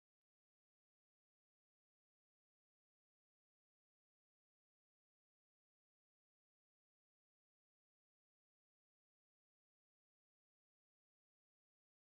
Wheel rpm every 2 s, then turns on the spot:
0, 0, 0, 0, 0, 0.
none